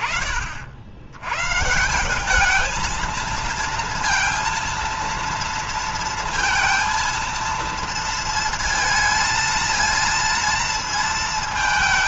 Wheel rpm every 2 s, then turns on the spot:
70, 220, 230, 230, 230, 230.
none